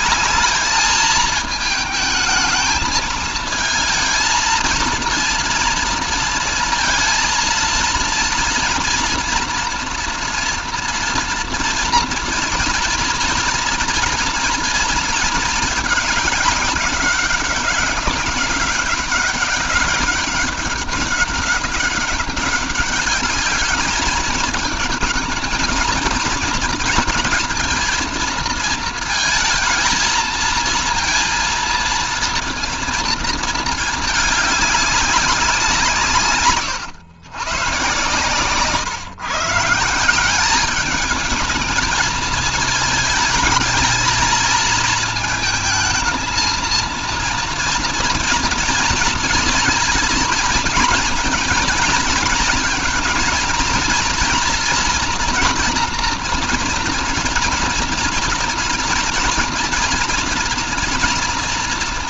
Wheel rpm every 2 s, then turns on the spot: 220, 220, 230, 230, 240, 240, 240, 230, 200, 200, 200, 200, 220, 220, 230, 230, 230, 200, 120, 150, 210, 220, 220, 230, 230, 230, 230, 230, 230, 240, 230.
none